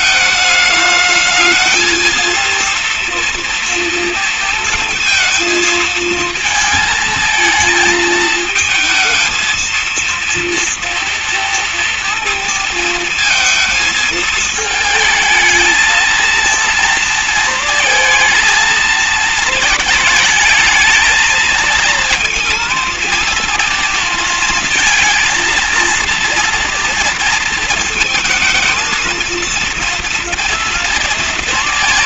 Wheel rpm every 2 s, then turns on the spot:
220, 230, 230, 220, 220, 230, 230, 220, 230, 220, 210, 230, 230, 230, 220, 230.
none